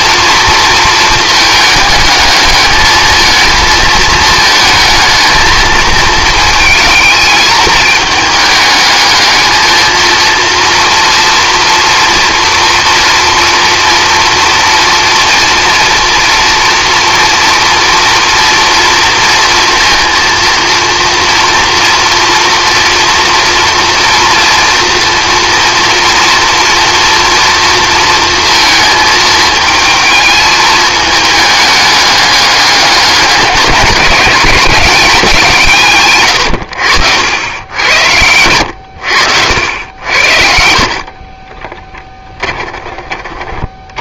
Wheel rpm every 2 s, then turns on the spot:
220, 220, 220, 220, 210, 230, 230, 230, 230, 240, 230, 230, 230, 230, 230, 220, 200, 180, 90, 100, 60, 20.
40-42